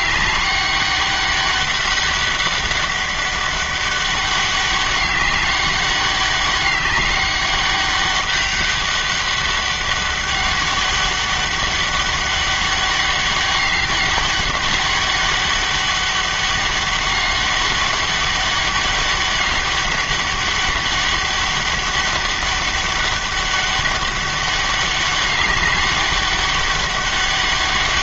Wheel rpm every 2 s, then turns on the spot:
200, 200, 200, 200, 200, 200, 200, 200, 200, 200, 200, 200, 200, 200.
none